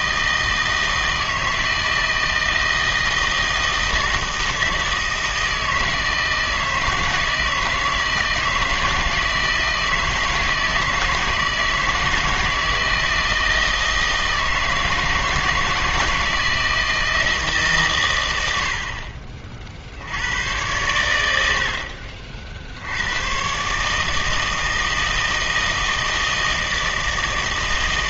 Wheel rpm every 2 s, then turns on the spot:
160, 160, 160, 160, 160, 160, 160, 160, 160, 80, 100, 70, 160, 160.
none